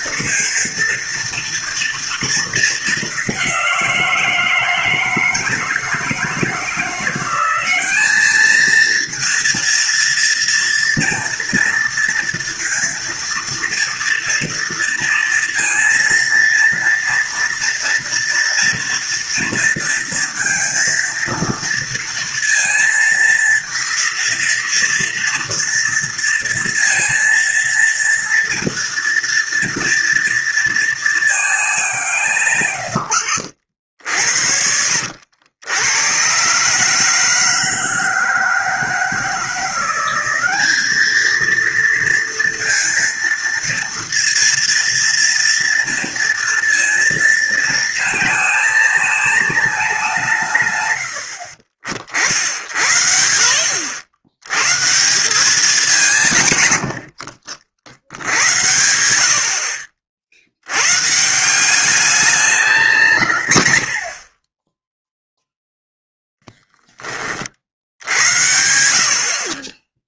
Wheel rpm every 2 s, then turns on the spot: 230, 220, 160, 170, 220, 230, 230, 240, 230, 230, 230, 230, 230, 230, 230, 230, 130, 60, 140, 160, 200, 230, 230, 230, 220, 120, 50, 130, 110, 90, 90, 190, 20, 10, 60.
34-36